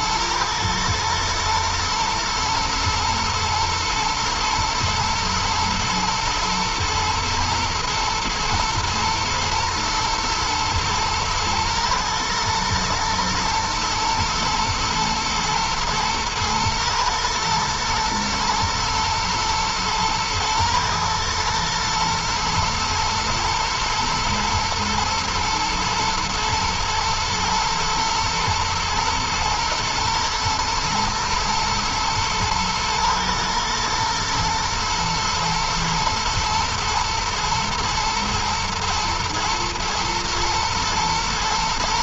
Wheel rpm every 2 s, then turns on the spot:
120, 120, 120, 110, 110, 120, 110, 110, 120, 120, 120, 110, 110, 120, 120, 110, 110, 120, 120, 110, 110.
none